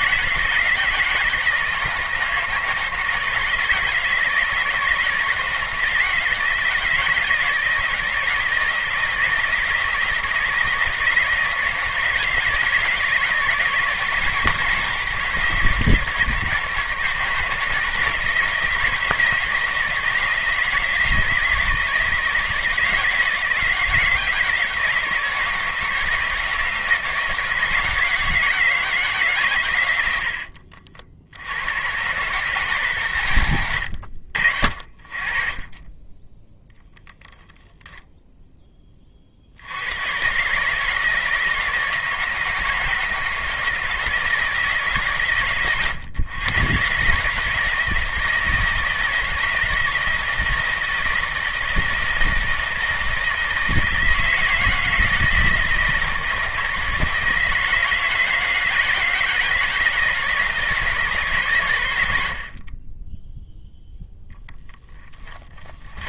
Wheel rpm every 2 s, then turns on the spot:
160, 160, 160, 160, 170, 160, 160, 160, 160, 160, 160, 160, 170, 170, 160, 60, 130, 40, 0, 30, 150, 160, 150, 140, 160, 160, 160, 160, 160, 170, 150, 20, 10.
64-66